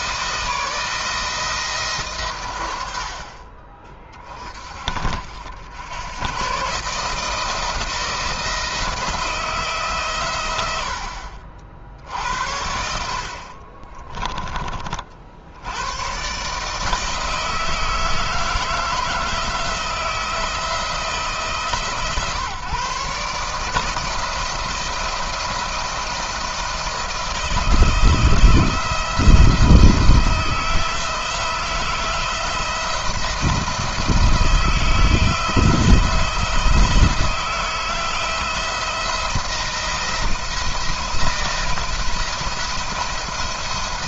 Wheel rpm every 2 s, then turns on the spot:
160, 100, 40, 140, 170, 90, 60, 30, 150, 160, 160, 140, 170, 170, 160, 160, 170, 170, 160, 170, 170, 160.
none